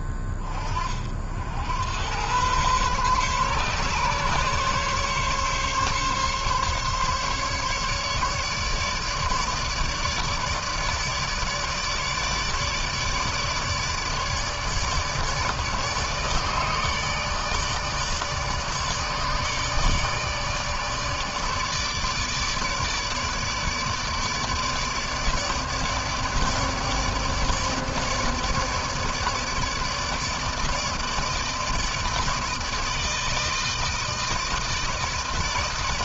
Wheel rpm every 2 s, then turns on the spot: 20, 110, 140, 140, 150, 150, 150, 160, 150, 150, 150, 150, 150, 150, 150, 150, 160, 160.
none